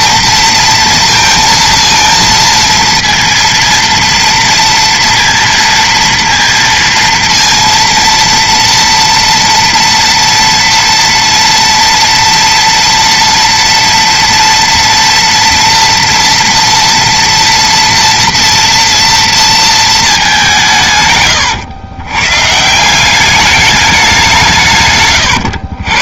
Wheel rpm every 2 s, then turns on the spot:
230, 230, 230, 230, 230, 230, 230, 230, 230, 230, 170, 160, 150.
none